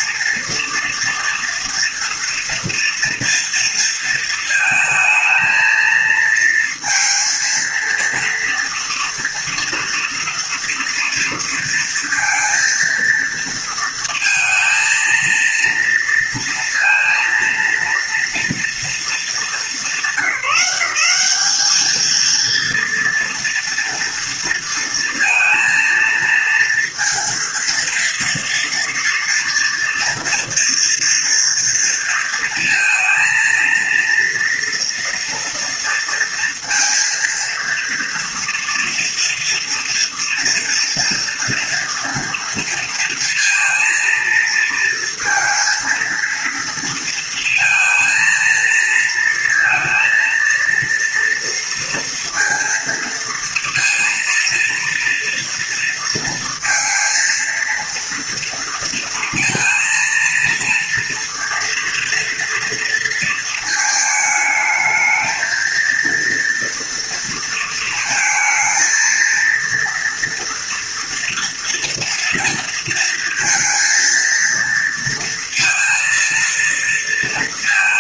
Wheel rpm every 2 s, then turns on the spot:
230, 230, 230, 230, 230, 240, 230, 220, 230, 230, 200, 230, 230, 230, 230, 240, 230, 230, 230, 230, 230, 230, 230, 230, 230, 230, 230, 230, 230, 230, 230, 230, 220, 230, 230, 230, 230, 230, 230.
none